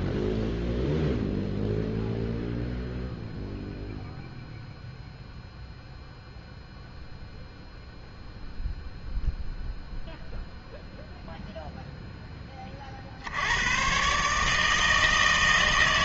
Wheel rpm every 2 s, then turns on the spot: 0, 0, 0, 0, 0, 0, 40, 160.
none